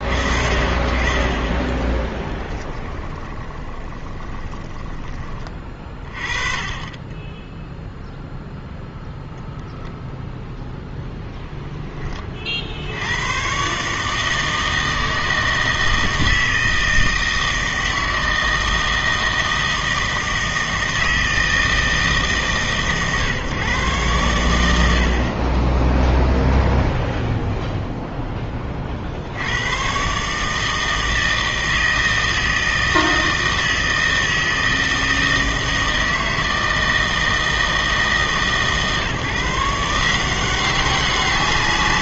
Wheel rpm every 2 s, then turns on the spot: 40, 20, 20, 30, 0, 0, 50, 160, 160, 160, 160, 150, 100, 0, 20, 150, 160, 160, 160, 150, 190.
2-6